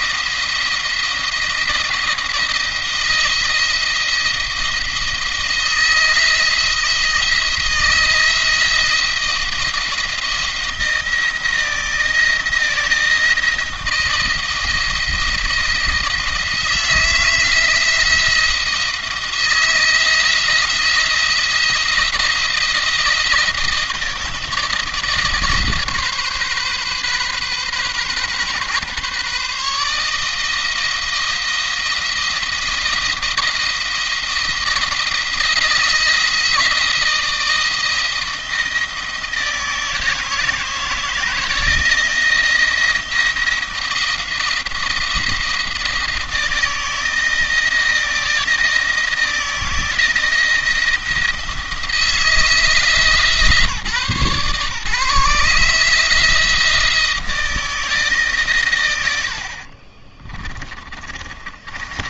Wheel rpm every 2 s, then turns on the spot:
170, 170, 170, 160, 170, 170, 170, 170, 170, 170, 170, 170, 160, 130, 140, 160, 170, 170, 170, 160, 160, 170, 170, 160, 170, 170, 160, 150, 160, 100, 30.
60-62